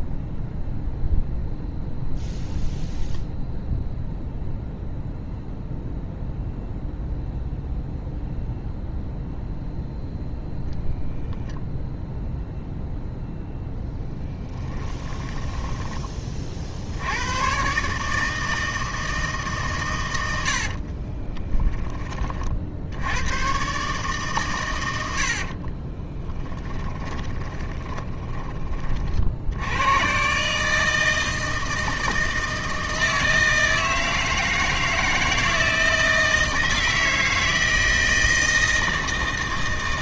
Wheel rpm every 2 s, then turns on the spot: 0, 0, 0, 0, 0, 0, 0, 10, 60, 160, 60, 50, 110, 10, 20, 150, 160, 160, 160, 160.
14-16 20-22 26-28